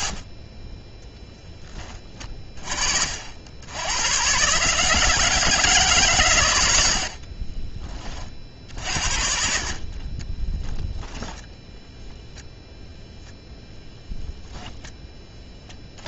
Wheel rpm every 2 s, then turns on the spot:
10, 50, 160, 70, 60, 10, 0, 30.
6-8 14-16